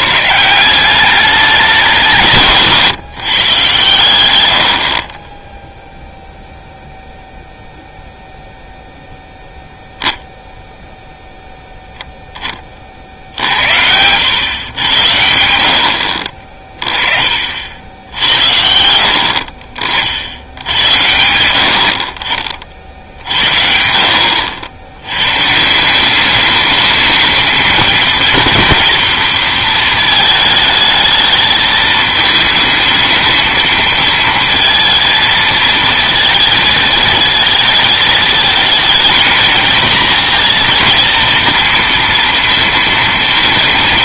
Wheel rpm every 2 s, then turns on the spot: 170, 150, 90, 0, 0, 0, 30, 100, 40, 70, 90, 50, 70, 210, 230, 220, 220, 230, 220, 220, 230, 230.
2-4